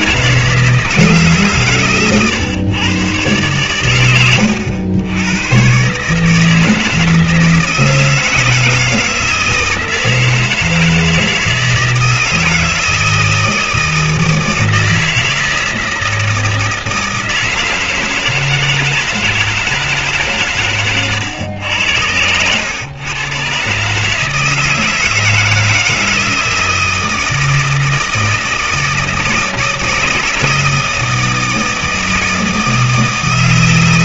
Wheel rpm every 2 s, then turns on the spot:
160, 130, 100, 160, 160, 160, 160, 160, 160, 160, 130, 100, 160, 160, 160, 160, 160.
none